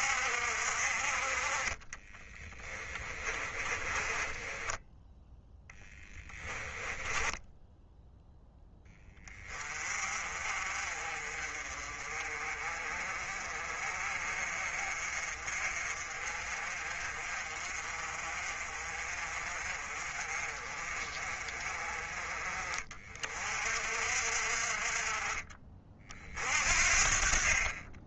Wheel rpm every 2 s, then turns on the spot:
50, 20, 10, 10, 20, 40, 40, 40, 40, 40, 40, 40, 40, 50.
2-8